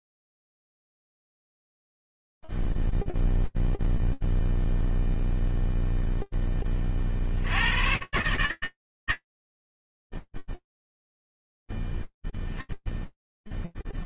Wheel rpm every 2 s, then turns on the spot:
0, 0, 0, 40, 120, 0, 0.
none